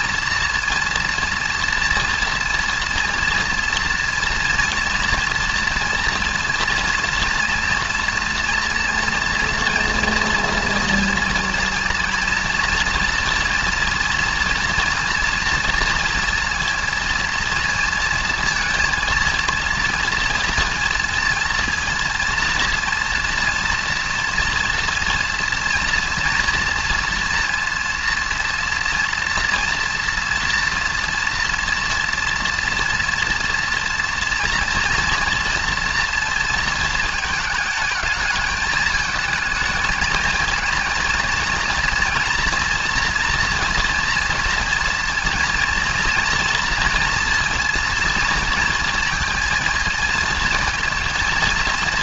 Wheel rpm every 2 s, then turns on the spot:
230, 230, 230, 230, 240, 230, 230, 230, 230, 230, 230, 230, 230, 230, 230, 230, 230, 230, 230, 220, 220, 240, 230, 230, 230, 230.
none